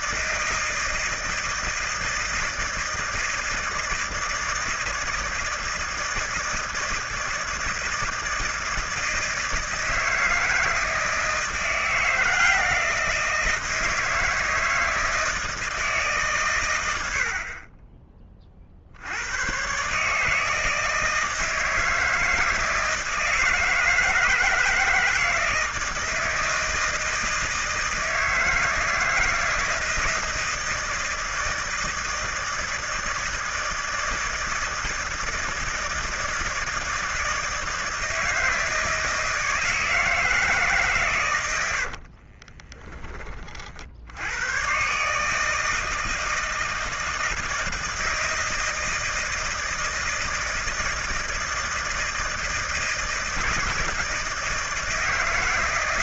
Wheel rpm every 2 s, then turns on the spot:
160, 160, 160, 160, 160, 160, 170, 160, 90, 60, 160, 160, 160, 160, 160, 160, 160, 160, 160, 160, 140, 20, 120, 160, 160, 160, 160, 160.
42-44